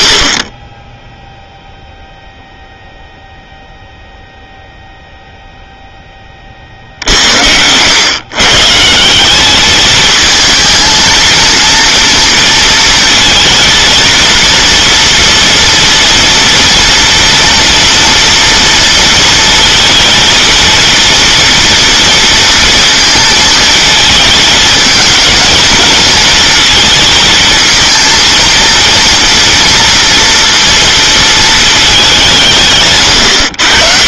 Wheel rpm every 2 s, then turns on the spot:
20, 0, 0, 60, 150, 220, 230, 230, 230, 230, 230, 230, 220, 220, 230, 230, 140.
none